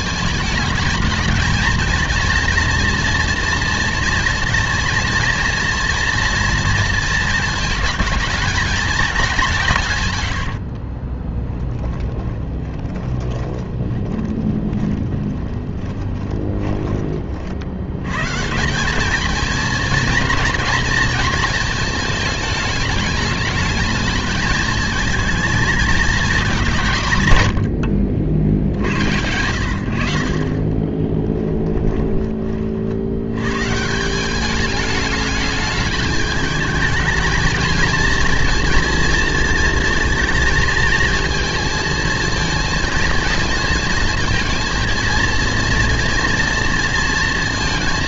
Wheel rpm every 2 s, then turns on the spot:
210, 230, 230, 230, 220, 30, 20, 20, 30, 190, 230, 210, 220, 160, 80, 20, 60, 210, 220, 230, 220, 220, 230, 240.
10-16 30-32